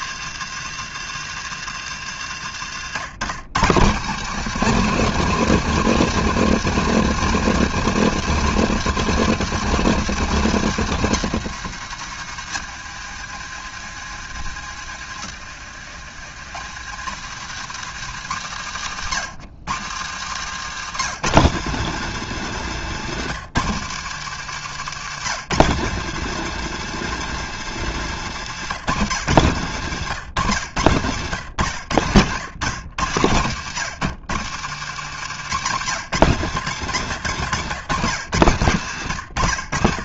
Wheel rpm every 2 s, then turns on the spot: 160, 120, 210, 200, 200, 180, 110, 100, 110, 110, 150, 160, 150, 190, 150, 110, 120, 130, 130, 120.
none